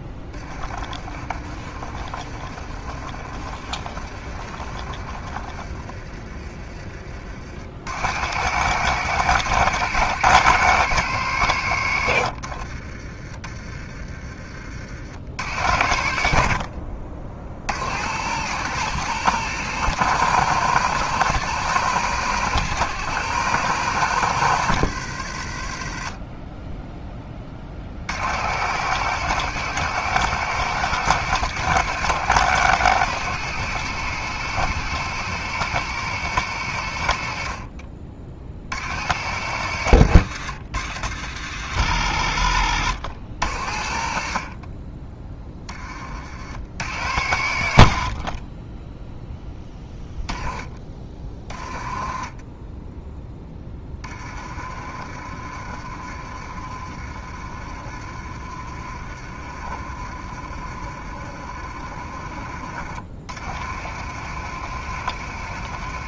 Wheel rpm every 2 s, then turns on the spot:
20, 40, 40, 30, 120, 130, 50, 50, 60, 130, 140, 140, 100, 10, 100, 130, 130, 130, 110, 70, 80, 70, 40, 70, 30, 20, 10, 40, 40, 40, 40, 40, 70.
0-6 12-14 16-18 42-44 52-62